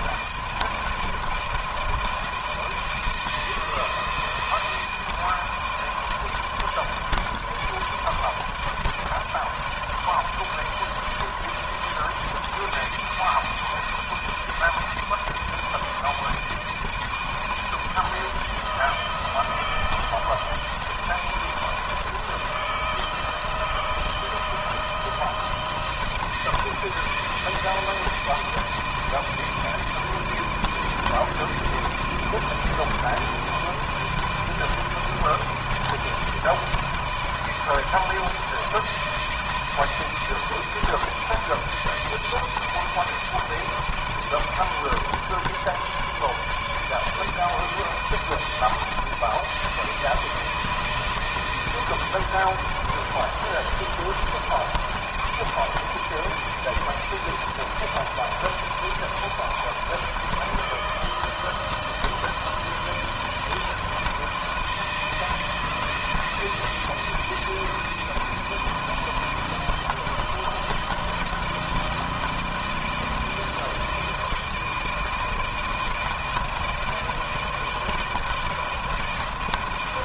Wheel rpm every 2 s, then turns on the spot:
160, 160, 160, 160, 160, 160, 160, 160, 160, 160, 160, 160, 160, 160, 160, 160, 160, 160, 160, 160, 160, 160, 160, 150, 160, 160, 160, 160, 170, 160, 160, 170, 160, 160, 160, 160, 160, 160, 160, 160.
none